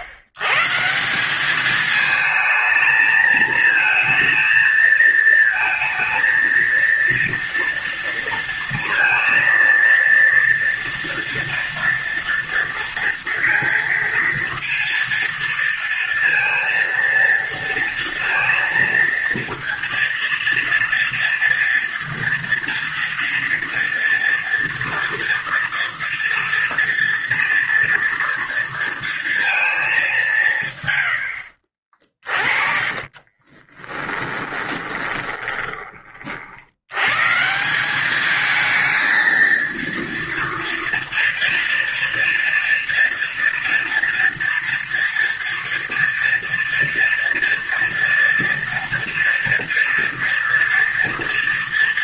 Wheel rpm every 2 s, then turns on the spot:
130, 220, 230, 230, 230, 230, 230, 230, 230, 230, 230, 230, 230, 230, 230, 160, 30, 20, 50, 210, 230, 230, 230, 230, 230, 230.
32-36